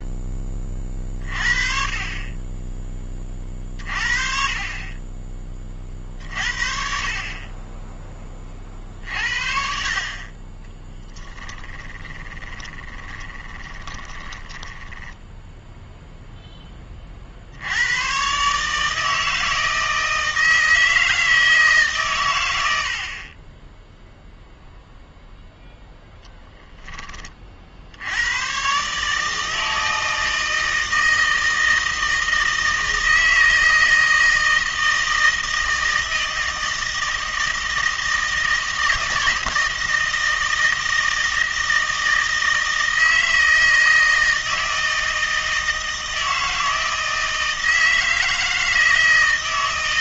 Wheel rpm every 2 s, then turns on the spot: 30, 10, 40, 40, 50, 20, 20, 10, 20, 150, 160, 80, 0, 10, 130, 160, 160, 160, 160, 160, 160, 160, 160, 160, 160.
12-16